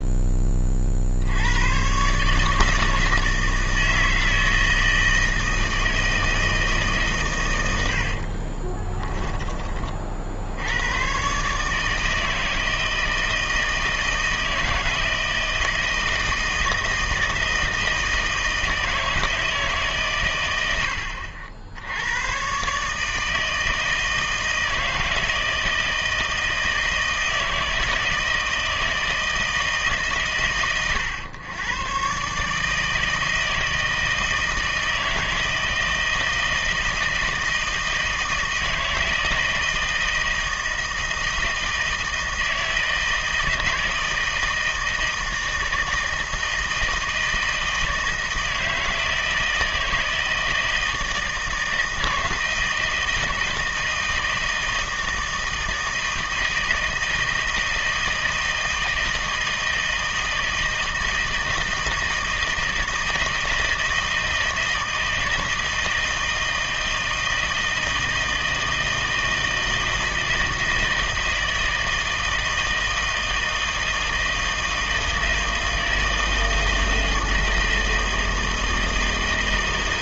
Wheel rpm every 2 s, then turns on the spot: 40, 160, 160, 150, 30, 80, 160, 160, 160, 160, 80, 140, 160, 160, 160, 110, 160, 160, 160, 160, 160, 160, 160, 160, 160, 160, 160, 160, 160, 160, 160, 160, 160, 160, 160, 160, 160, 160, 160, 160.
8-10